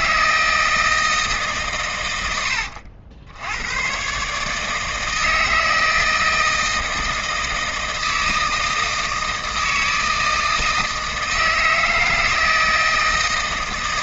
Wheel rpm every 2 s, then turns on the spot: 140, 100, 160, 160, 160, 160, 160.
none